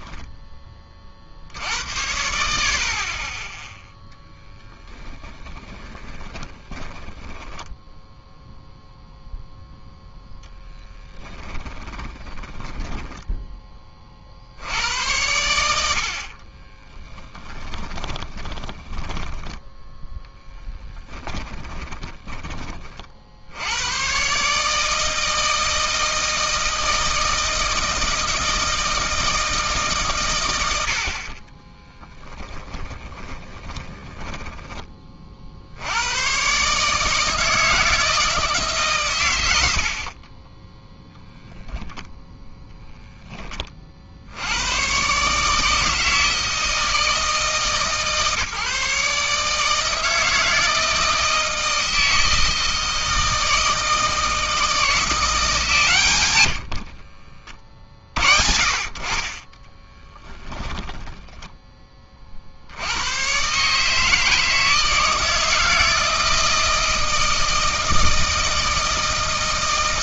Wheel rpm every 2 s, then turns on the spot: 80, 10, 20, 10, 0, 20, 20, 80, 20, 10, 10, 70, 160, 160, 160, 40, 20, 50, 160, 100, 0, 10, 140, 160, 150, 160, 160, 170, 40, 40, 10, 80, 160, 160, 160.
4-8 10-12 16-22 30-34 56-58 60-62